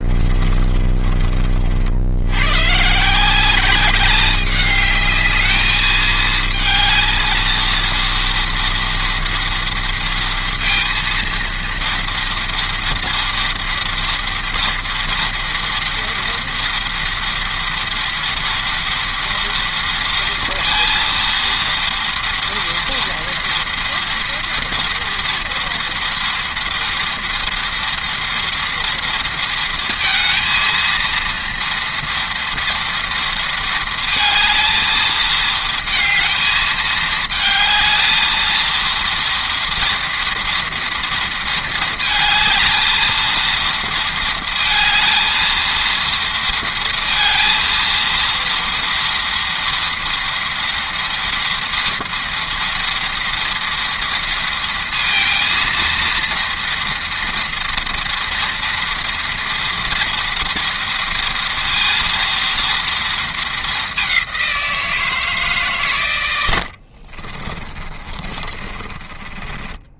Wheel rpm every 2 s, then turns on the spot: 40, 180, 210, 220, 230, 230, 230, 230, 230, 230, 230, 230, 230, 230, 230, 230, 230, 220, 220, 230, 230, 220, 230, 230, 230, 230, 230, 230, 230, 230, 230, 220, 160, 40, 20.
66-70